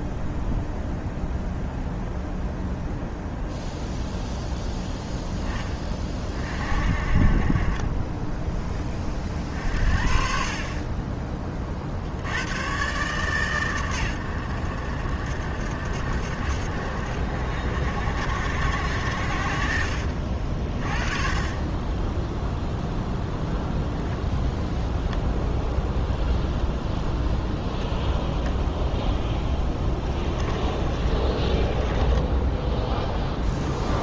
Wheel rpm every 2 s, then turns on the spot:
0, 0, 0, 30, 20, 30, 120, 80, 70, 60, 30, 0, 0, 0, 0, 20, 0.
30-32